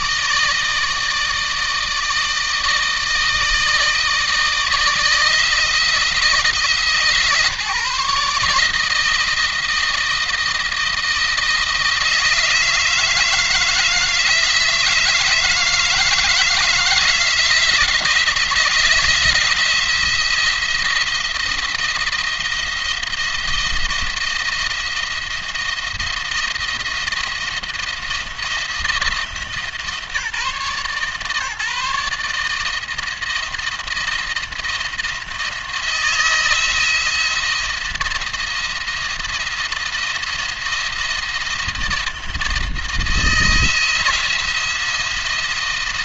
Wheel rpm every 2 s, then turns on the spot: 160, 160, 160, 150, 160, 170, 160, 160, 160, 170, 170, 170, 170, 170, 170, 150, 160, 170, 170, 170, 170, 160, 170.
none